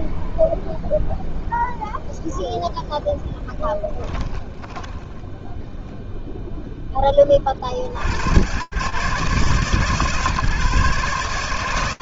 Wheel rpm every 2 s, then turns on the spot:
0, 0, 10, 0, 90, 150.
4-6